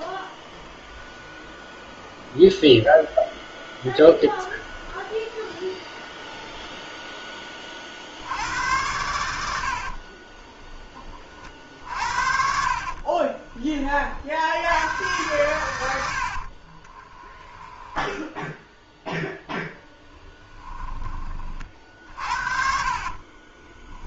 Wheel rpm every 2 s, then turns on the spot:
0, 0, 0, 0, 90, 20, 40, 110, 30, 0, 20, 50.
12-14 16-18 22-24